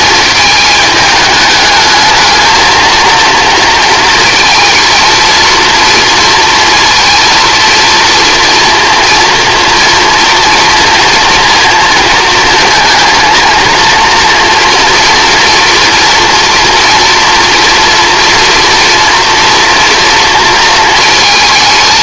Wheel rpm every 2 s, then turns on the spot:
220, 220, 230, 230, 230, 230, 230, 230, 230, 230, 230.
none